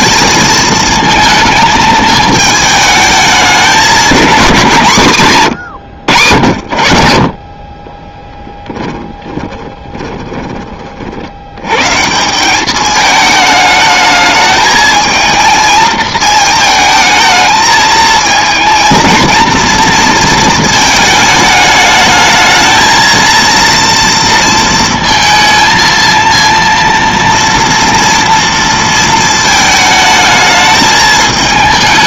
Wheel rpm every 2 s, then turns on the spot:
220, 210, 170, 70, 10, 30, 200, 220, 220, 230, 220, 220, 230, 230, 230, 220.
8-10